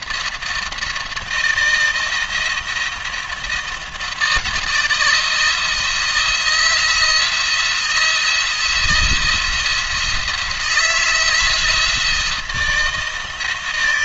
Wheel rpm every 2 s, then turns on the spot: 160, 170, 160, 170, 170, 160, 160.
none